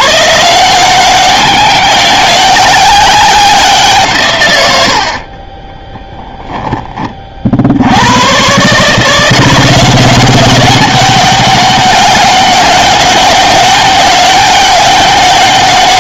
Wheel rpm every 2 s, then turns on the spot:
180, 190, 80, 20, 150, 200, 200, 200.
none